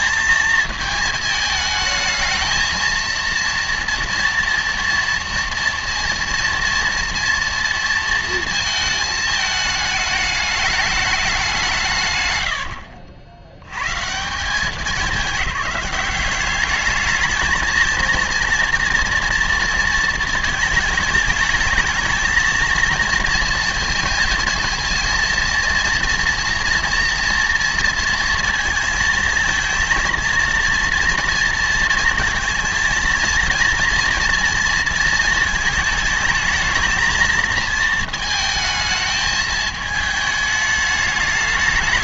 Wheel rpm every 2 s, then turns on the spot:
220, 220, 230, 230, 230, 210, 80, 190, 210, 230, 220, 230, 230, 230, 230, 230, 230, 230, 220, 220, 210.
12-14